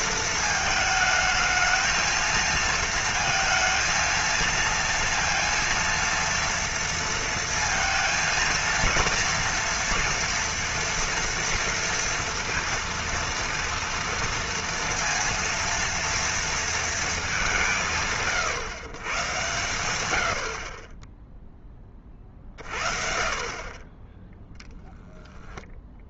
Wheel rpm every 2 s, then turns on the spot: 220, 230, 230, 230, 230, 230, 230, 230, 230, 120, 40, 40, 10.
none